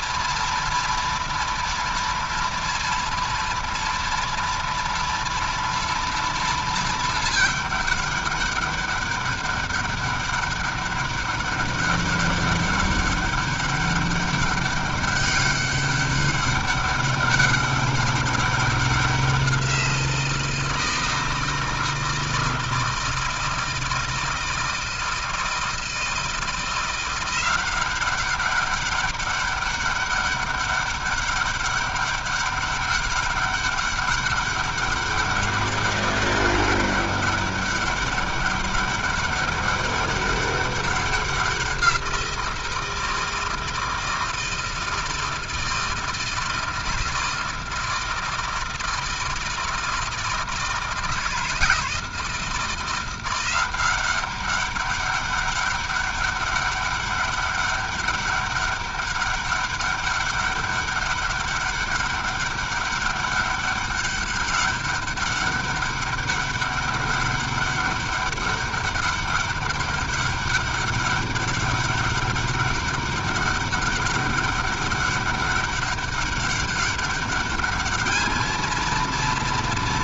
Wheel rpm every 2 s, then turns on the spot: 230, 230, 230, 230, 200, 200, 200, 200, 200, 190, 160, 160, 160, 170, 200, 200, 200, 200, 200, 200, 200, 170, 160, 160, 160, 160, 160, 190, 200, 200, 200, 200, 200, 200, 200, 200, 200, 200, 200, 220.
none